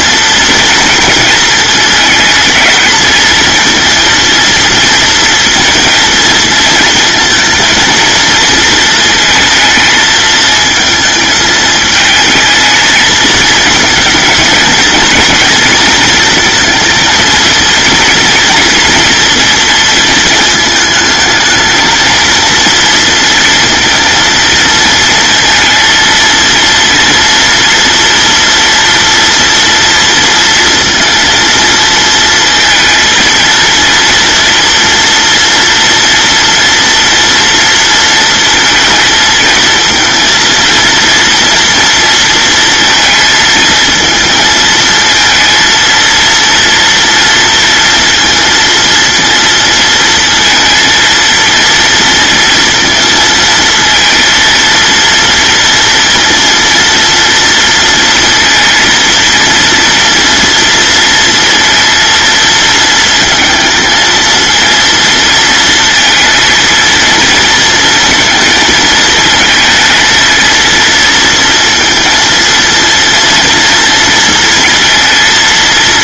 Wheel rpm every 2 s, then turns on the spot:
230, 220, 230, 230, 230, 220, 220, 220, 230, 230, 220, 230, 230, 230, 230, 230, 230, 230, 240, 220, 230, 230, 230, 230, 230, 230, 230, 230, 230, 230, 230, 230, 230, 230, 220, 230, 230, 230.
none